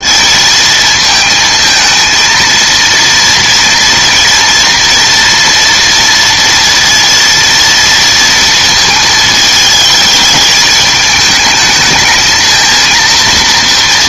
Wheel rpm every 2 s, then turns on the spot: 220, 230, 230, 230, 220, 220, 230.
none